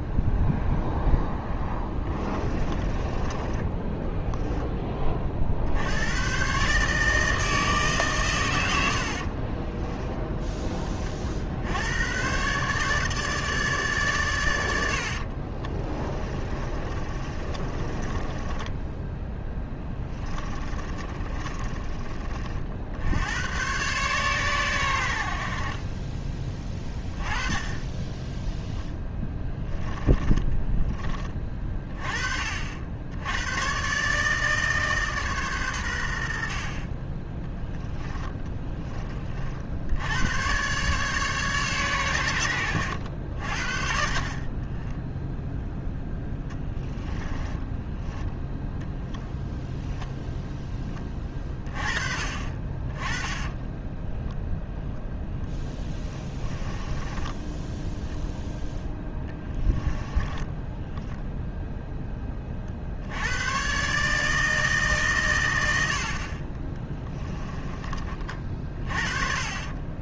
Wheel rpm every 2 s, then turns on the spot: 0, 20, 20, 140, 80, 20, 140, 70, 30, 10, 30, 60, 100, 20, 10, 20, 70, 150, 40, 20, 130, 80, 10, 10, 0, 10, 30, 0, 10, 0, 10, 50, 150, 20, 40.
2-4 14-22 28-30 46-48 56-58 60-62